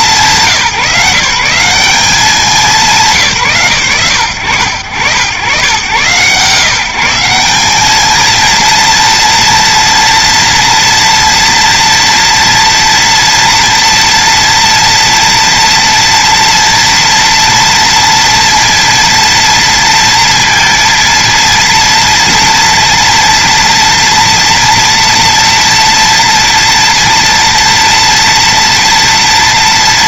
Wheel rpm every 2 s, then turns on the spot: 190, 190, 90, 130, 220, 230, 230, 230, 230, 230, 230, 230, 240, 230, 230.
none